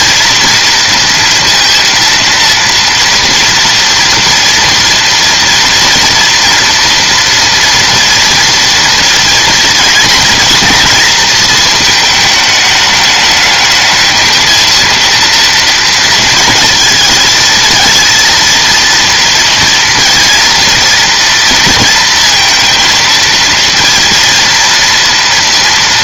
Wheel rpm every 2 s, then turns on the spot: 230, 230, 230, 230, 230, 230, 210, 230, 230, 230, 230, 230, 230.
none